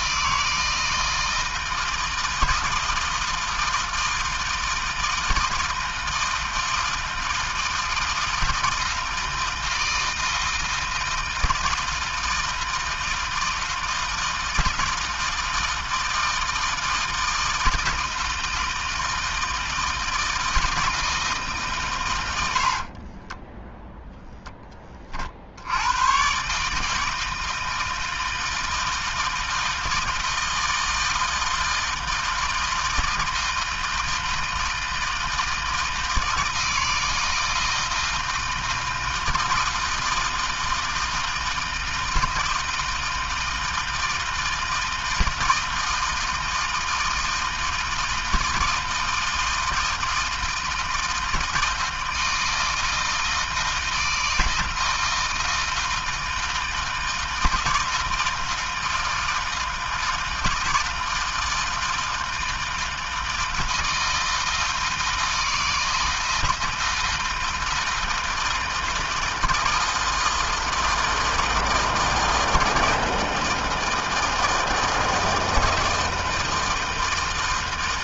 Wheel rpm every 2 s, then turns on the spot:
160, 160, 160, 160, 160, 160, 160, 160, 160, 160, 160, 30, 40, 160, 160, 160, 160, 160, 160, 160, 160, 160, 160, 160, 160, 160, 160, 160, 160, 160, 160, 160, 160, 160, 160, 160, 160, 160, 160.
22-24